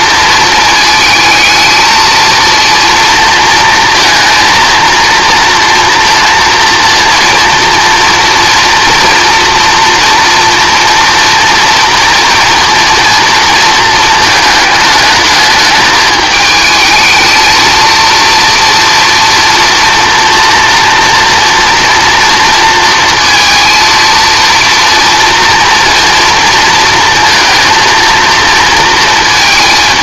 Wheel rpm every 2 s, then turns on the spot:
220, 230, 230, 230, 230, 230, 230, 220, 220, 230, 240, 230, 230, 230, 230.
none